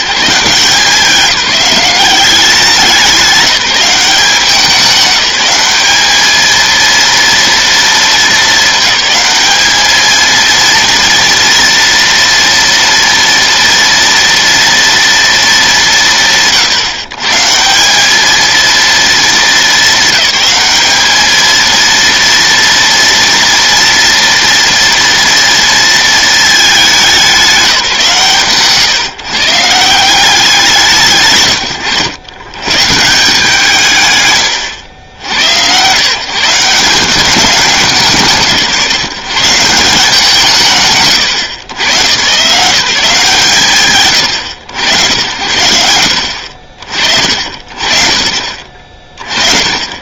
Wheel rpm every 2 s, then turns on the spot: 180, 190, 200, 230, 210, 230, 230, 230, 150, 230, 210, 230, 230, 210, 150, 150, 170, 90, 170, 150, 150, 160, 100, 50, 40.
none